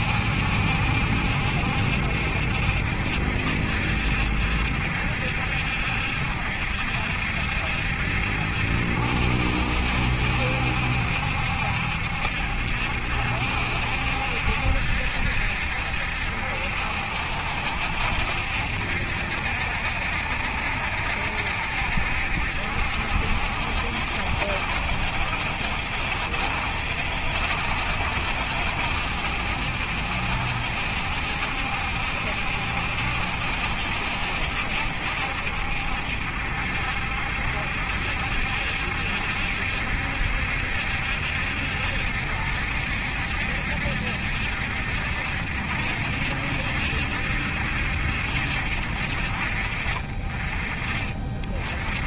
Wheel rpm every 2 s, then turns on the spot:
70, 70, 70, 70, 70, 70, 70, 70, 70, 70, 70, 70, 70, 70, 70, 70, 70, 70, 70, 70, 70, 70, 70, 70, 70, 30.
none